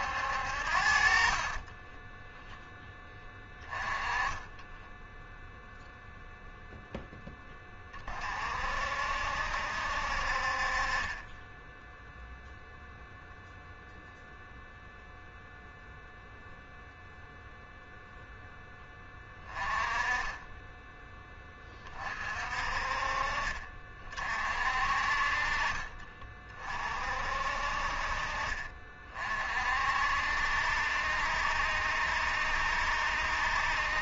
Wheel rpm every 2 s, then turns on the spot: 60, 0, 10, 0, 50, 40, 0, 0, 0, 10, 10, 40, 40, 40, 40, 70, 70.
4-6